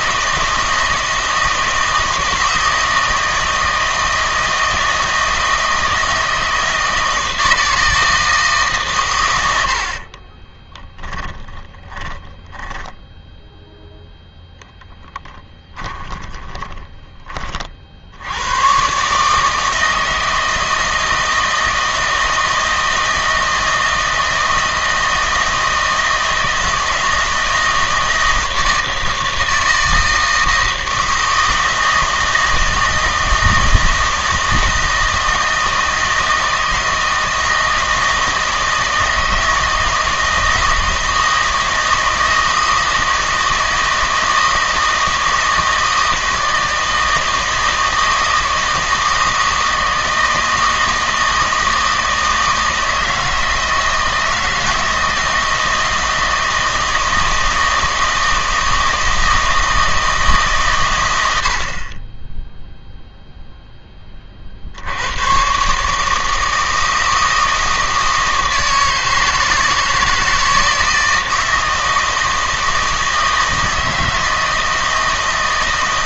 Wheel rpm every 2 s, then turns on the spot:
160, 160, 160, 160, 140, 20, 10, 10, 20, 120, 160, 160, 160, 160, 160, 160, 160, 160, 160, 160, 160, 160, 160, 160, 160, 160, 160, 160, 160, 160, 130, 0, 70, 160, 160, 160, 160, 160.
10-18